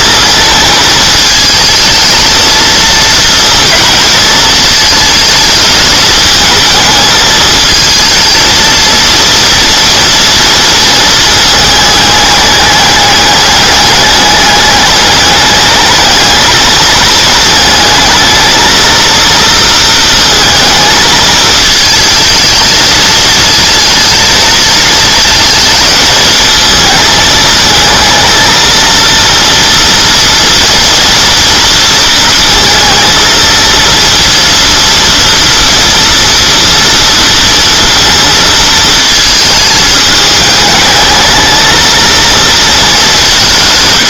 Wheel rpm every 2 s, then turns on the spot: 220, 220, 220, 220, 230, 230, 210, 210, 220, 230, 230, 220, 230, 220, 230, 240, 230, 230, 230, 220, 210, 220.
none